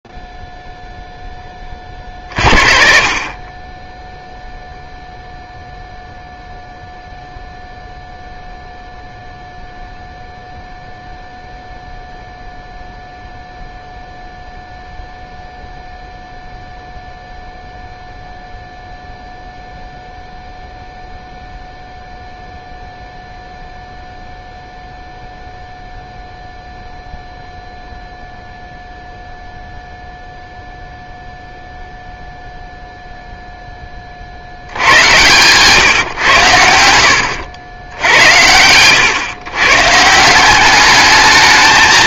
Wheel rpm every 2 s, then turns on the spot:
0, 20, 10, 0, 0, 0, 0, 0, 0, 0, 0, 0, 0, 0, 0, 0, 0, 80, 110, 80, 190.
36-40